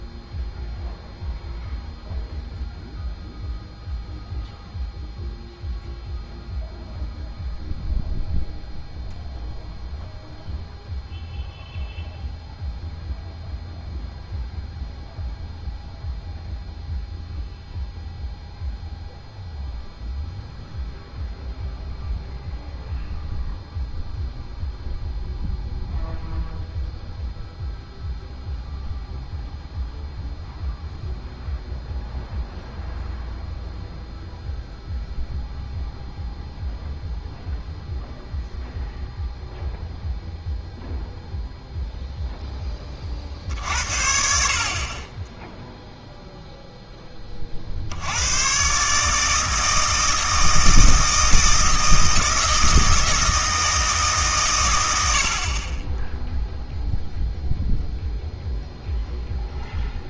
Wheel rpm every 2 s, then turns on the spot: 0, 0, 0, 0, 0, 0, 0, 0, 0, 0, 0, 0, 0, 0, 0, 0, 0, 0, 0, 0, 0, 20, 50, 0, 140, 160, 160, 100, 0, 0.
none